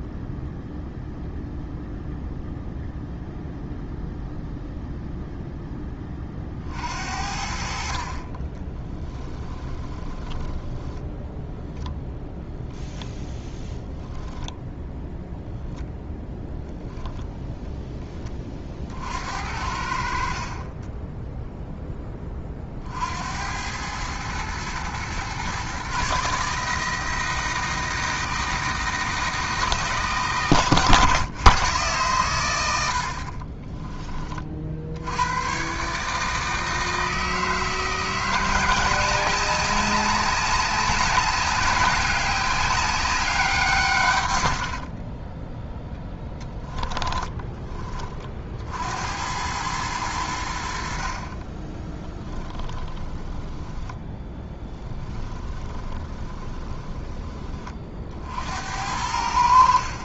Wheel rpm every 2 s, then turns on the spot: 0, 0, 0, 60, 10, 10, 0, 0, 0, 50, 20, 60, 120, 160, 160, 130, 80, 70, 160, 180, 200, 190, 40, 20, 80, 60, 10, 20, 20, 80.
8-12 30-32 44-48 52-58